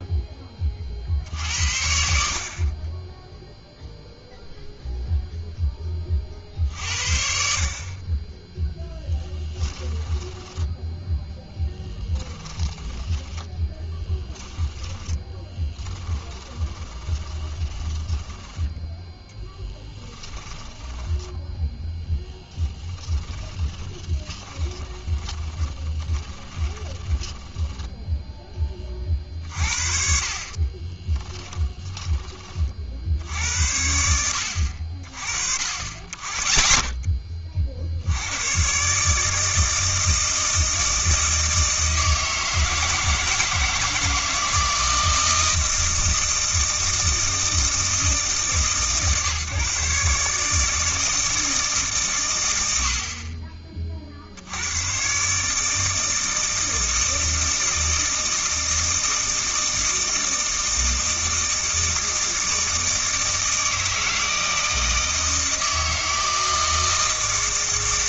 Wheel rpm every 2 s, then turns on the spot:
40, 30, 0, 60, 0, 10, 10, 10, 20, 10, 10, 10, 20, 20, 30, 30, 60, 60, 40, 140, 160, 160, 160, 160, 150, 160, 70, 110, 160, 160, 160, 160, 160, 160.
10-28 30-32